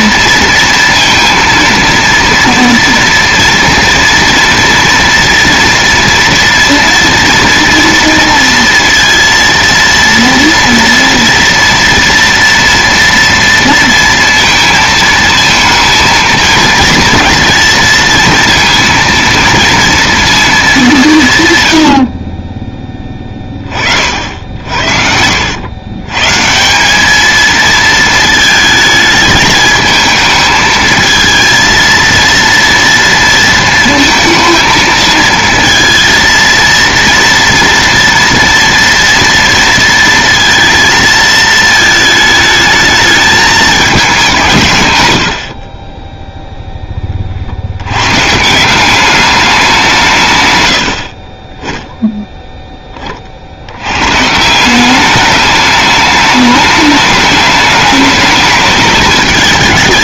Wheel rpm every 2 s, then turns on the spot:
230, 230, 230, 230, 230, 230, 230, 230, 230, 230, 190, 10, 60, 200, 220, 220, 230, 220, 230, 240, 230, 210, 110, 20, 190, 80, 20, 190, 210, 210.
24-26 50-52